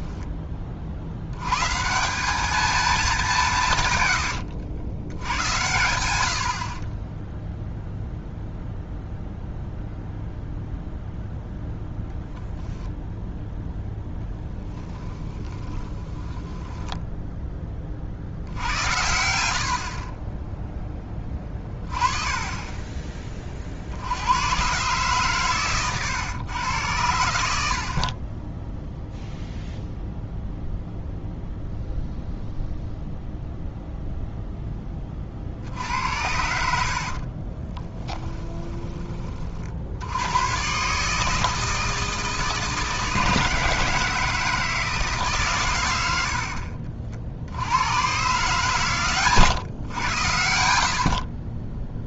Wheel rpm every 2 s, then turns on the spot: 40, 210, 90, 40, 0, 0, 0, 10, 10, 90, 10, 20, 120, 110, 10, 0, 0, 10, 80, 10, 120, 160, 160, 60, 130, 70.
14-18 28-30 46-48